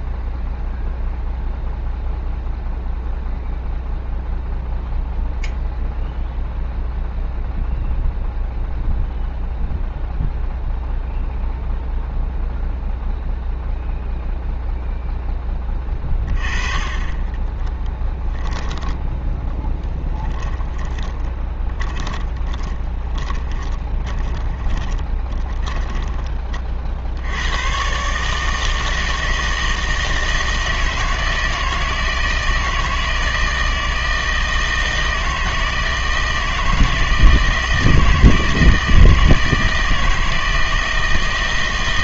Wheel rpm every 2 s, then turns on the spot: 0, 0, 0, 0, 0, 0, 0, 0, 30, 10, 20, 20, 20, 40, 160, 160, 160, 160, 160, 160, 160.
20-26